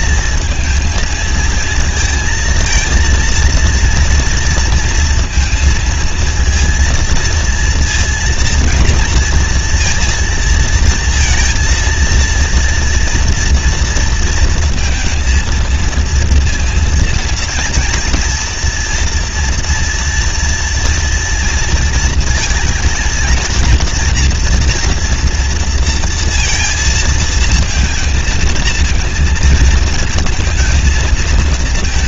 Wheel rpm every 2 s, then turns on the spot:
220, 230, 230, 230, 230, 230, 230, 230, 230, 230, 230, 230, 230, 230, 230, 230.
none